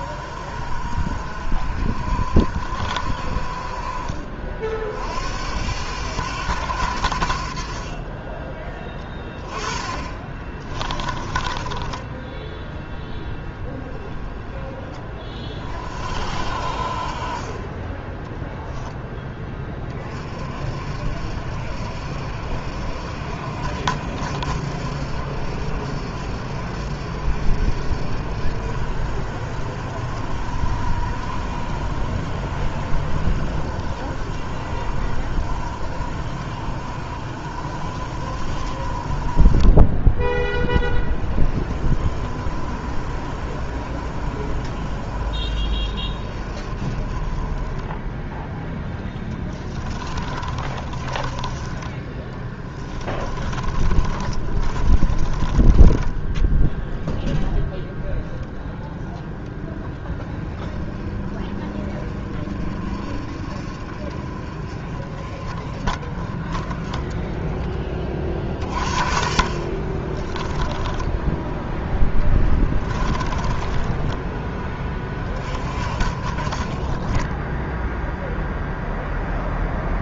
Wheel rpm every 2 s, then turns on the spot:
60, 60, 50, 90, 20, 30, 10, 20, 50, 0, 40, 60, 60, 60, 60, 60, 60, 60, 60, 50, 20, 50, 50, 40, 10, 20, 20, 30, 10, 10, 20, 40, 40, 20, 30, 10, 20, 20, 40, 0.
10-12 50-56 70-74